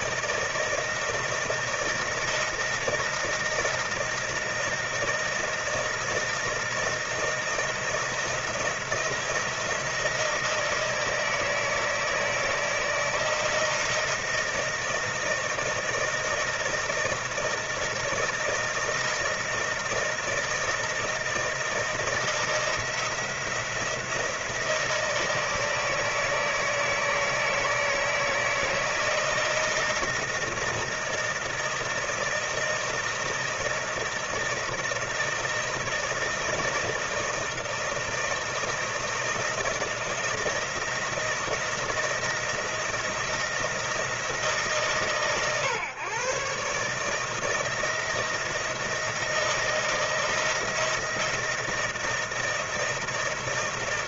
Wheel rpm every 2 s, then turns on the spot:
160, 160, 160, 160, 170, 160, 160, 160, 160, 160, 160, 160, 170, 160, 160, 160, 160, 160, 160, 160, 160, 170, 150, 130, 160, 160, 160.
none